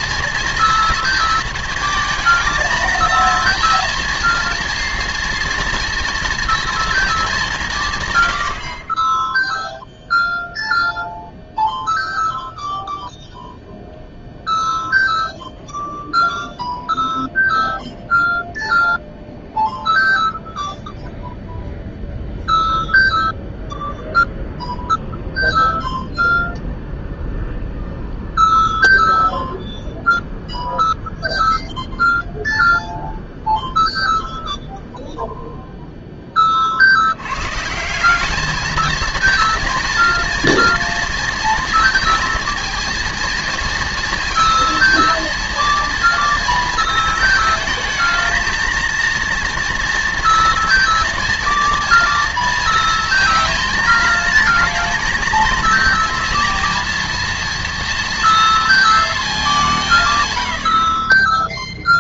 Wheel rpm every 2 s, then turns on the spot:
230, 220, 230, 230, 70, 0, 0, 0, 0, 0, 0, 0, 0, 0, 0, 0, 0, 0, 30, 220, 240, 230, 230, 230, 220, 230, 230, 230, 230, 230, 100.
none